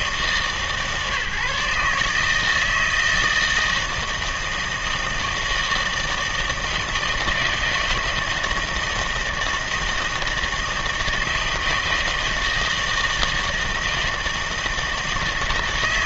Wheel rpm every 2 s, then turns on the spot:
150, 160, 160, 160, 160, 160, 160, 160.
none